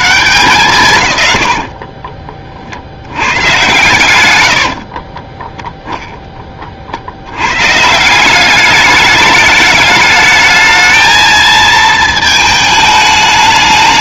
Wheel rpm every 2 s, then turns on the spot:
140, 50, 80, 40, 200, 220, 220.
none